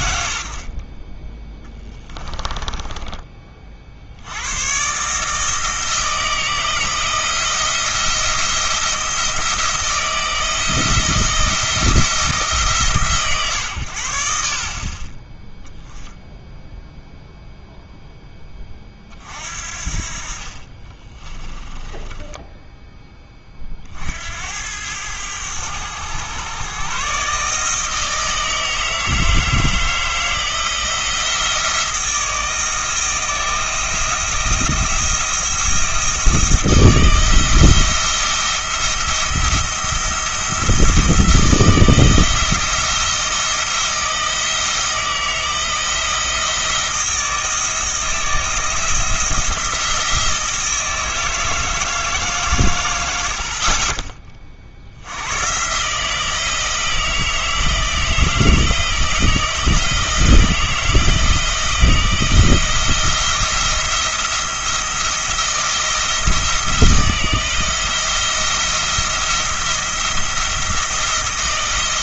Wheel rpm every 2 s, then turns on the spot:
80, 20, 120, 160, 170, 170, 140, 60, 0, 20, 30, 10, 90, 130, 160, 170, 160, 170, 160, 170, 160, 160, 160, 160, 170, 160, 110, 60, 160, 160, 160, 170, 170, 170, 170, 170.
2-4 20-24